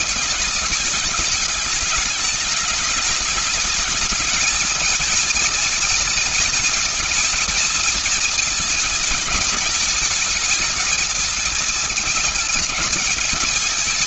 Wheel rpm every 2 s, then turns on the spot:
210, 210, 230, 230, 220, 220, 220.
none